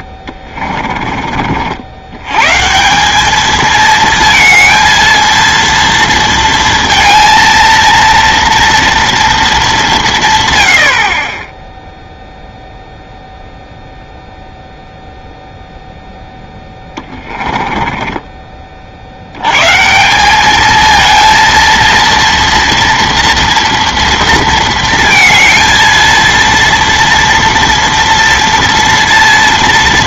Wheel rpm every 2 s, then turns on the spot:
30, 150, 230, 230, 230, 90, 0, 0, 10, 40, 210, 230, 220, 230, 230.
0-2 16-18